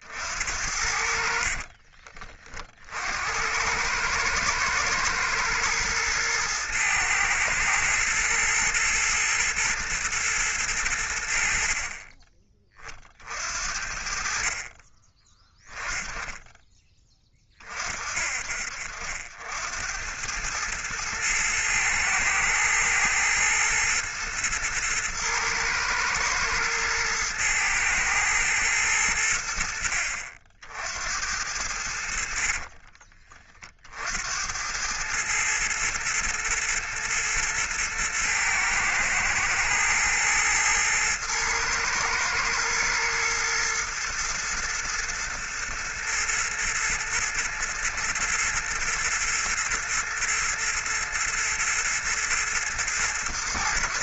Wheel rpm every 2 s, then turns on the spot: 60, 60, 110, 110, 120, 90, 40, 30, 10, 50, 110, 110, 110, 110, 100, 80, 50, 100, 120, 110, 110, 120, 110, 110, 110, 120, 110.
0-2 32-34